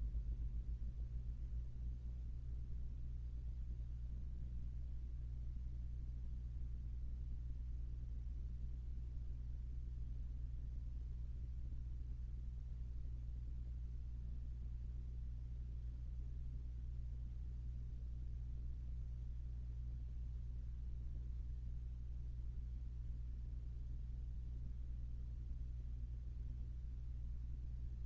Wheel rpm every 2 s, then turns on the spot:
0, 0, 0, 0, 0, 0, 0, 0, 0, 0, 0, 0, 0, 0.
none